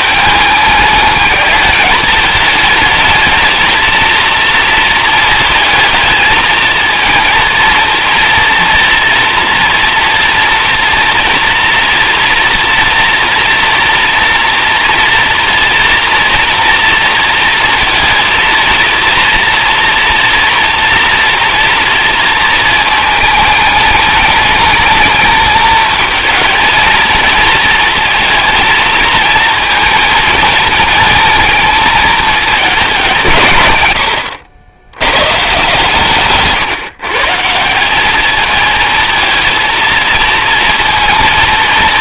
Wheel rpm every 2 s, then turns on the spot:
210, 210, 230, 220, 230, 230, 230, 230, 230, 230, 230, 230, 210, 220, 220, 220, 220, 90, 150, 220, 230.
36-38